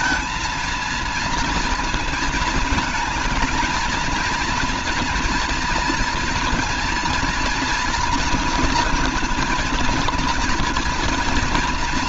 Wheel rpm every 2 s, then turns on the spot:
230, 220, 230, 230, 240, 230.
none